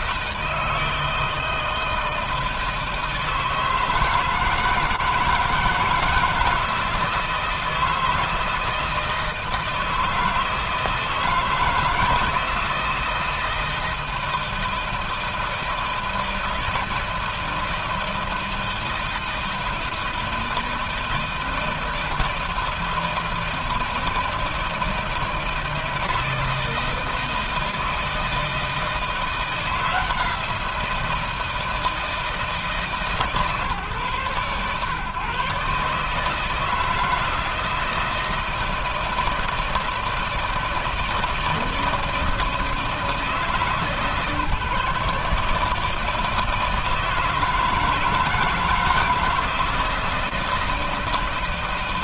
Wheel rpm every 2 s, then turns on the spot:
160, 160, 160, 160, 160, 160, 160, 160, 160, 160, 160, 160, 160, 160, 160, 170, 150, 120, 160, 160, 160, 160, 150, 160, 160, 160.
none